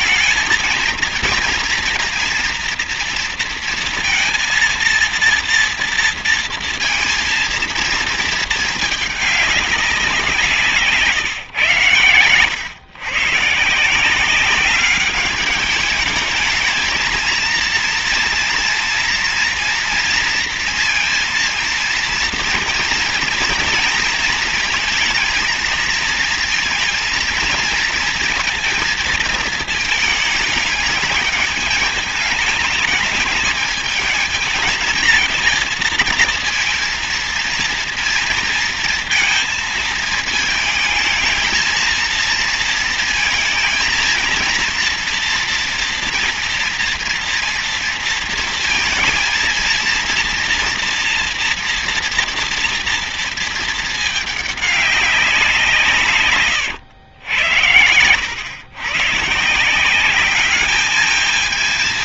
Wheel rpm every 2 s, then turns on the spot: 230, 230, 230, 230, 220, 170, 100, 190, 220, 230, 230, 230, 230, 230, 230, 220, 220, 220, 230, 230, 220, 230, 230, 240, 230, 230, 230, 210, 140, 110, 200.
none